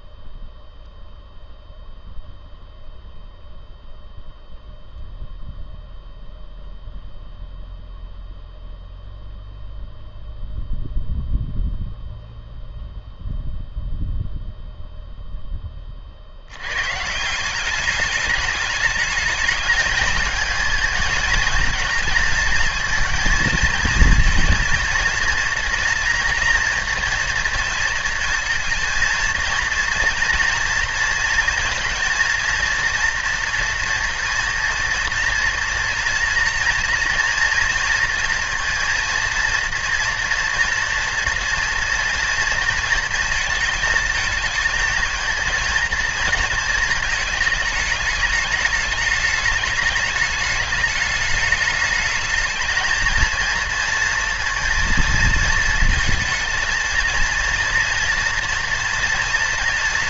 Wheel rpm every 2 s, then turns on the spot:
0, 0, 0, 0, 0, 0, 0, 0, 100, 210, 220, 230, 230, 230, 230, 230, 230, 230, 230, 230, 240, 230, 220, 220, 210, 210, 220, 230, 230, 230.
none